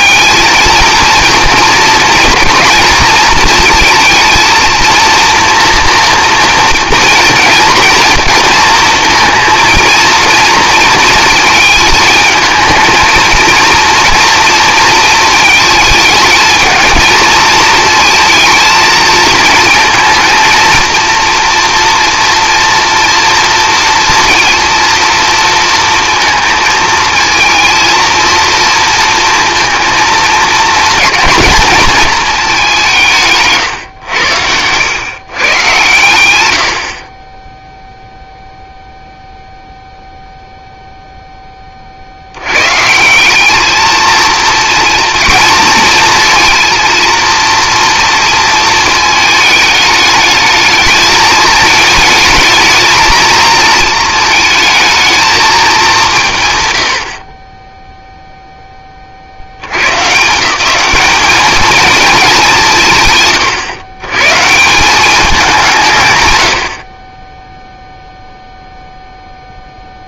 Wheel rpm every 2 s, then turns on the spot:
230, 230, 230, 230, 230, 230, 230, 230, 220, 220, 230, 230, 230, 220, 230, 230, 170, 120, 60, 0, 0, 160, 230, 230, 230, 220, 220, 220, 80, 40, 200, 140, 190, 50, 0.
none